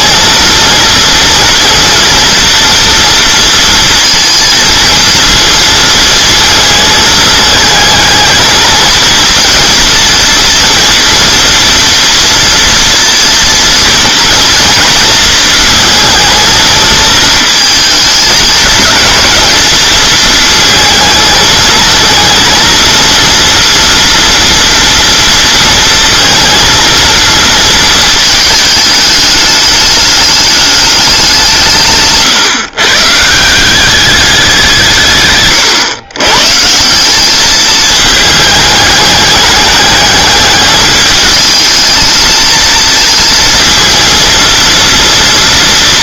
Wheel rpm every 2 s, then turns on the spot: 230, 240, 230, 220, 220, 230, 230, 230, 220, 220, 220, 230, 230, 230, 210, 210, 140, 160, 170, 210, 210, 220, 230.
none